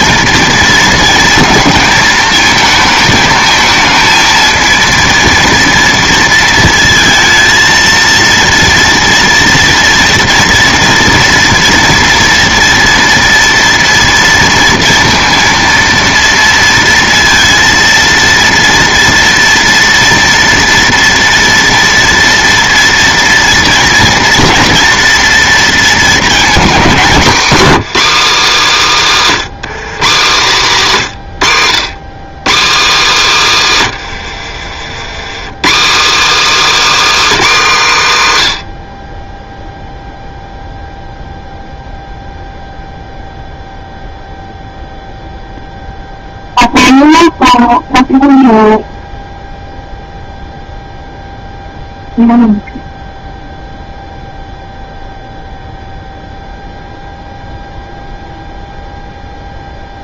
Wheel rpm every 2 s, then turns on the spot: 230, 220, 230, 230, 230, 230, 230, 230, 230, 230, 230, 230, 240, 220, 260, 180, 230, 90, 300, 120, 0, 0, 0, 0, 0, 0, 0, 0, 0, 0.
34-36